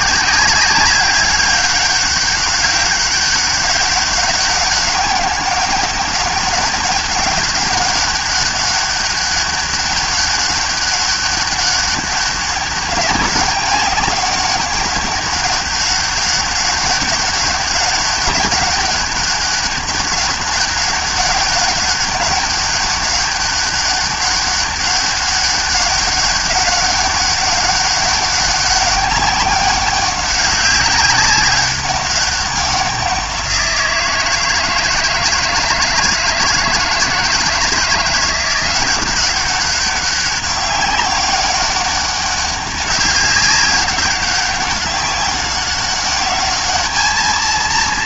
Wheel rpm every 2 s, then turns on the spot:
190, 200, 200, 190, 200, 200, 200, 200, 200, 200, 200, 200, 200, 200, 200, 200, 190, 160, 160, 170, 190, 200, 200, 210.
none